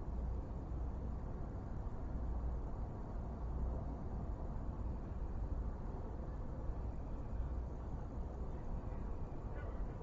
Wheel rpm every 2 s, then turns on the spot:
0, 0, 0, 0, 0.
none